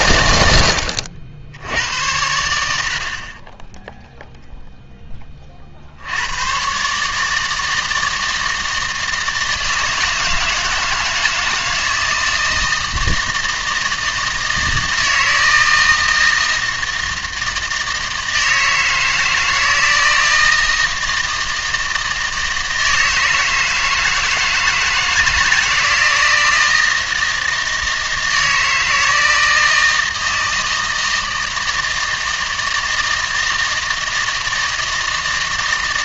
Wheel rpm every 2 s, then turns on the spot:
80, 80, 0, 120, 160, 160, 160, 160, 160, 160, 160, 160, 160, 160, 160, 160, 160, 160.
none